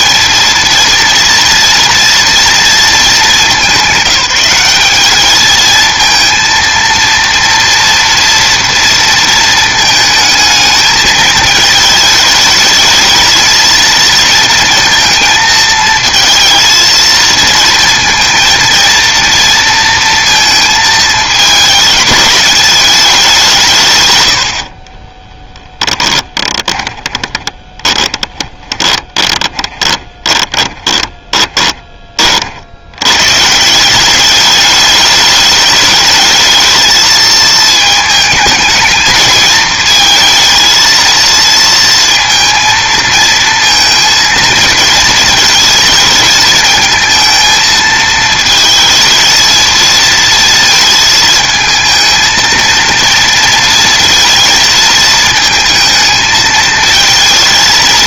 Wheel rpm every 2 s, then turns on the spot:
230, 220, 200, 230, 230, 220, 220, 230, 230, 230, 220, 200, 30, 20, 20, 20, 90, 210, 220, 220, 230, 230, 220, 220, 220, 220, 230, 220, 220.
24-32